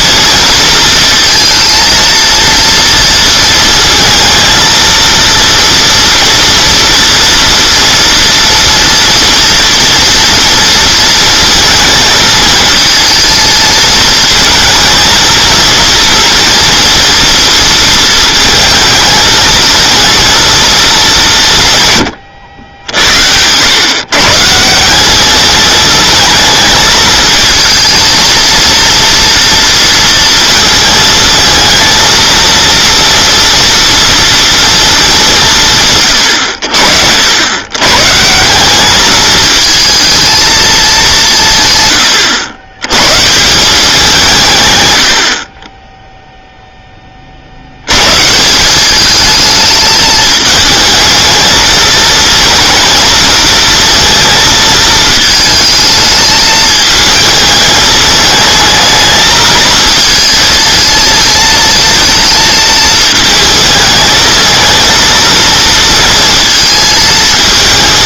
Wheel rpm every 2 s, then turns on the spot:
230, 230, 230, 240, 230, 230, 220, 220, 230, 220, 220, 80, 160, 220, 230, 230, 230, 230, 80, 190, 220, 110, 130, 0, 180, 220, 230, 220, 220, 220, 230, 220, 220, 220.
none